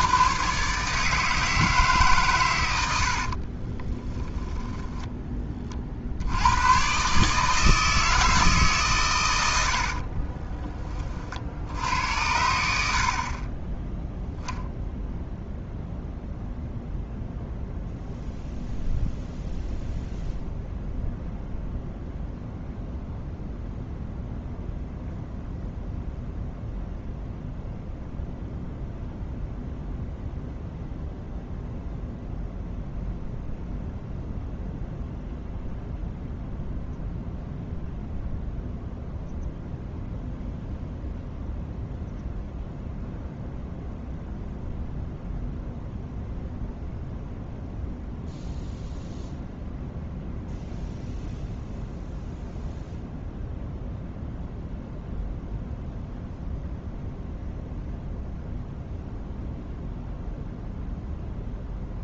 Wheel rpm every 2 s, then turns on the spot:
140, 90, 20, 120, 150, 20, 70, 0, 0, 0, 0, 0, 0, 0, 0, 0, 0, 0, 0, 0, 0, 0, 0, 0, 0, 0, 0, 0, 0, 0, 0.
4-6